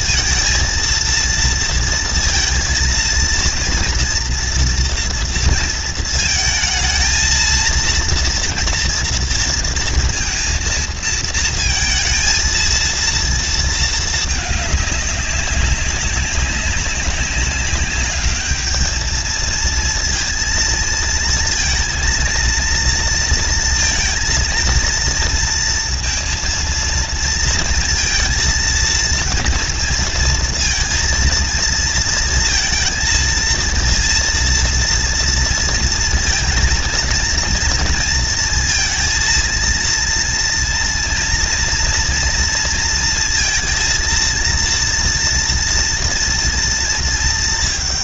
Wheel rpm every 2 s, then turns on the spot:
230, 230, 230, 230, 240, 230, 230, 220, 200, 210, 230, 230, 230, 230, 230, 230, 230, 230, 230, 230, 230, 230, 230, 230.
none